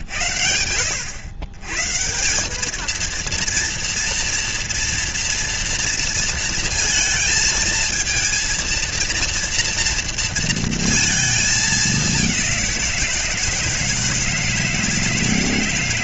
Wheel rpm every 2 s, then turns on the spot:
90, 200, 230, 230, 220, 230, 190, 160.
none